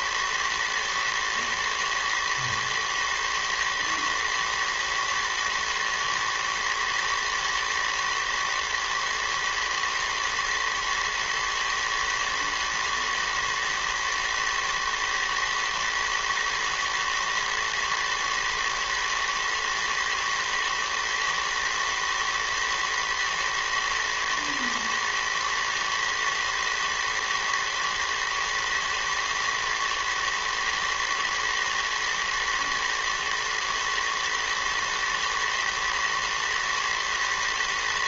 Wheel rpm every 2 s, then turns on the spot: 110, 120, 120, 110, 110, 110, 110, 110, 110, 120, 120, 110, 110, 110, 110, 110, 120, 110, 110.
none